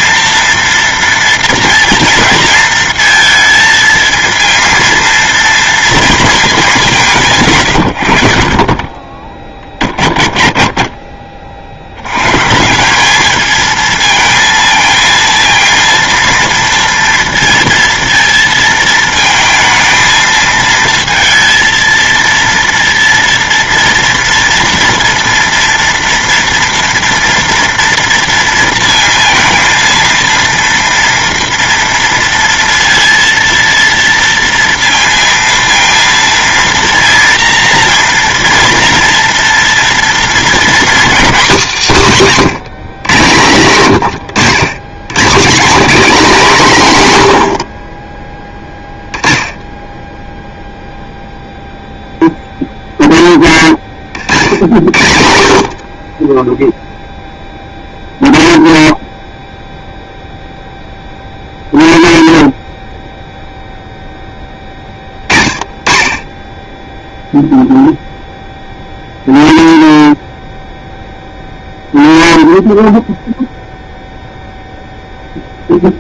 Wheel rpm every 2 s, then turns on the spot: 230, 230, 230, 200, 20, 30, 170, 230, 230, 230, 220, 230, 230, 230, 230, 230, 230, 230, 230, 230, 240, 180, 110, 200, 0, 0, 0, 70, 0, 0, 0, 0, 20, 0, 0, 0, 0, 0.
none